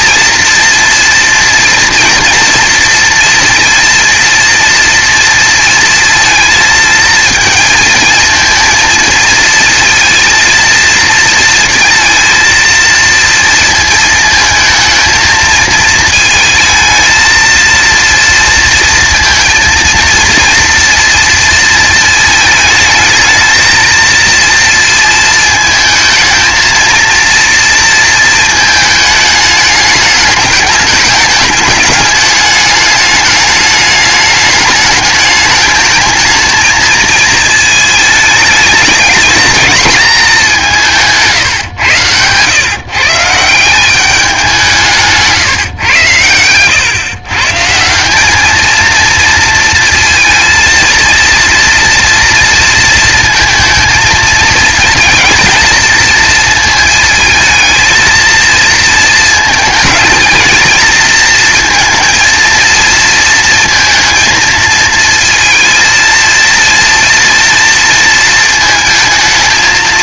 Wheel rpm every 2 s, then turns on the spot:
230, 230, 230, 220, 220, 230, 230, 220, 220, 230, 230, 220, 230, 230, 220, 210, 210, 210, 220, 210, 170, 150, 180, 120, 220, 230, 230, 220, 230, 230, 230, 230, 230, 230, 220.
none